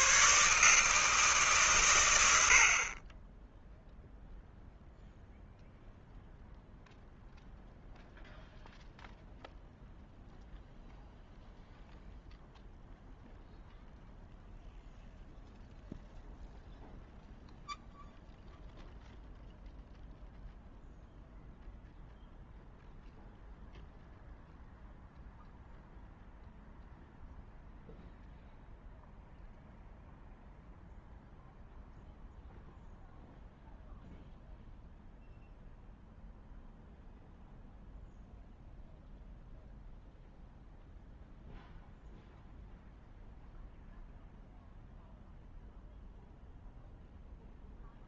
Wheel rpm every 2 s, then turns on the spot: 150, 70, 0, 0, 0, 0, 0, 0, 0, 0, 0, 0, 0, 0, 0, 0, 0, 0, 0, 0, 0, 0, 0, 0.
none